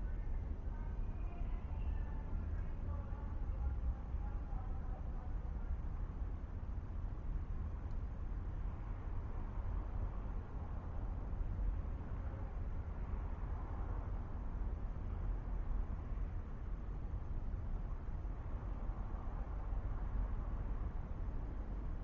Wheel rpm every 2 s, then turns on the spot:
0, 0, 0, 0, 0, 0, 0, 0, 0, 0, 0.
none